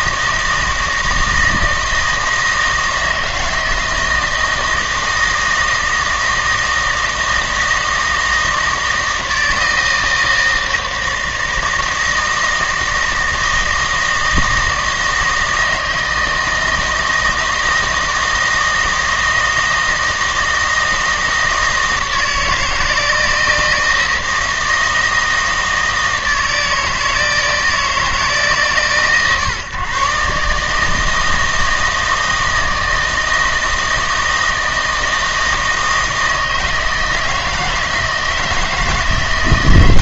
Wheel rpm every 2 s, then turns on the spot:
160, 160, 160, 160, 160, 160, 160, 160, 160, 160, 160, 160, 160, 160, 140, 150, 160, 160, 160, 160.
none